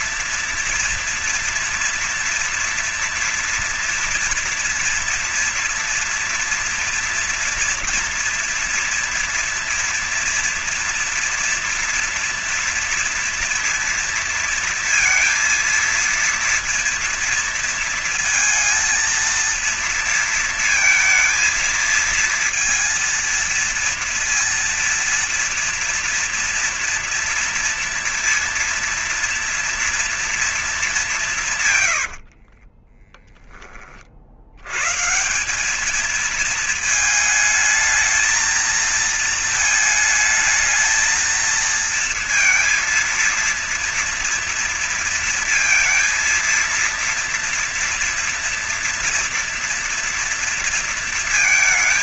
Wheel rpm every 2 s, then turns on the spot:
230, 230, 240, 230, 240, 230, 230, 230, 230, 230, 230, 230, 230, 230, 230, 220, 60, 70, 220, 220, 220, 230, 230, 230, 230, 230.
32-34